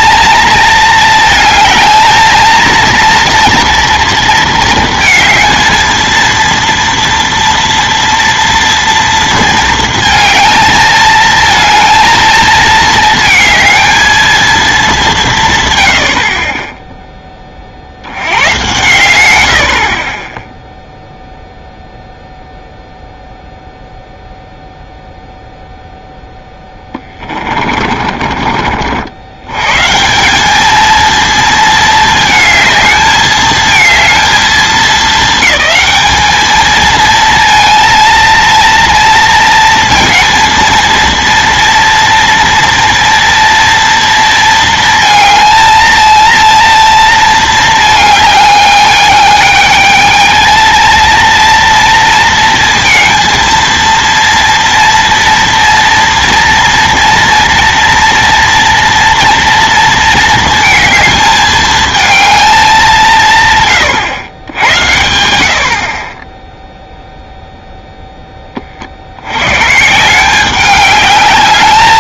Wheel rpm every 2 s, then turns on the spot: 220, 230, 230, 230, 230, 220, 220, 220, 20, 110, 0, 0, 0, 10, 50, 210, 220, 220, 220, 230, 230, 230, 230, 230, 210, 220, 230, 230, 230, 230, 220, 200, 90, 0, 30, 190.
26-28